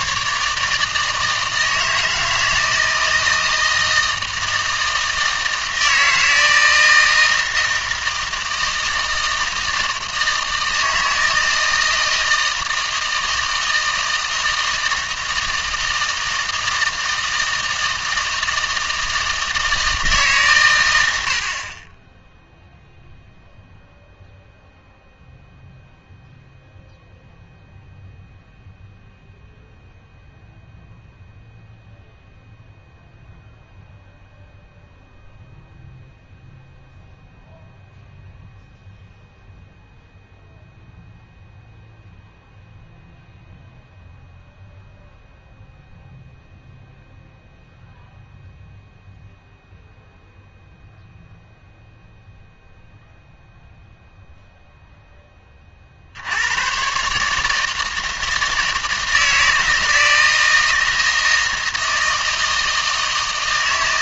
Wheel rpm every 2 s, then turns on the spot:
150, 160, 160, 160, 160, 160, 160, 160, 160, 160, 120, 0, 0, 0, 0, 0, 0, 0, 0, 0, 0, 0, 0, 0, 0, 0, 0, 0, 110, 160, 160, 160.
none